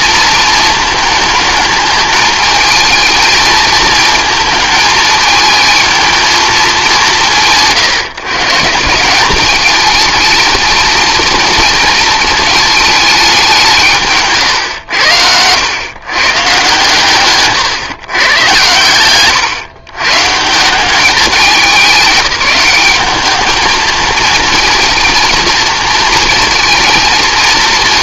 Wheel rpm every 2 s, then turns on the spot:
230, 210, 220, 210, 160, 220, 220, 130, 130, 120, 160, 190, 220, 220.
none